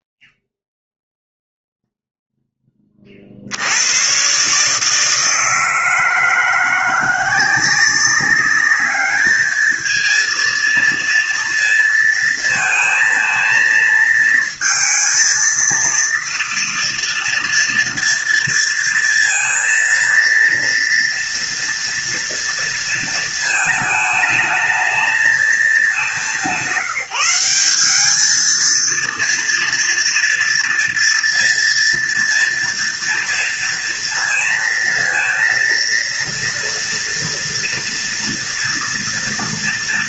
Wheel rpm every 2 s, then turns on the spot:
0, 0, 120, 170, 190, 230, 230, 230, 230, 230, 230, 230, 220, 190, 210, 230, 230, 230, 230, 230.
none